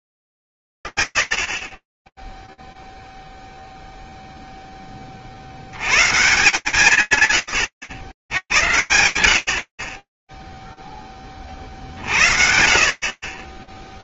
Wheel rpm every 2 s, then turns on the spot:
100, 0, 10, 140, 90, 0, 40.
none